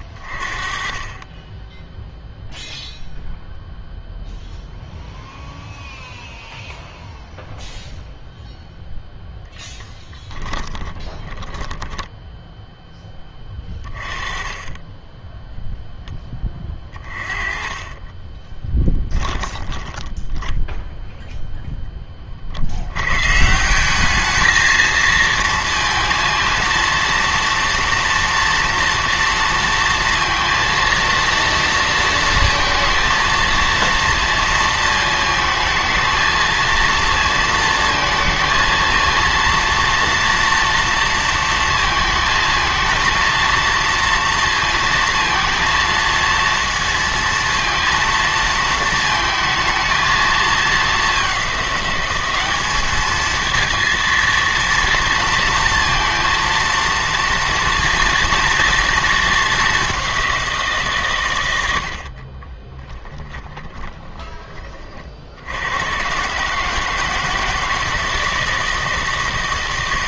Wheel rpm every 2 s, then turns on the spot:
30, 0, 0, 0, 0, 10, 10, 20, 30, 20, 10, 80, 220, 230, 230, 230, 230, 220, 230, 230, 230, 230, 230, 230, 220, 220, 210, 230, 230, 230, 150, 20, 40, 160, 160.
10-12 16-20 62-64